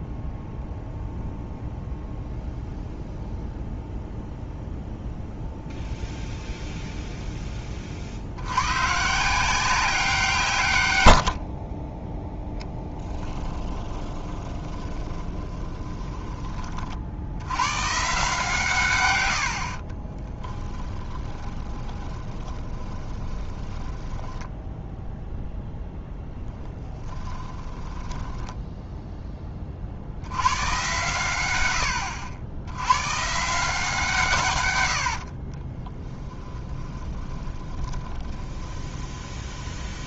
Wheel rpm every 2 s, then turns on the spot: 0, 0, 0, 0, 110, 120, 10, 20, 30, 140, 10, 20, 10, 10, 10, 120, 100, 110, 10, 20.
12-16 20-30 36-40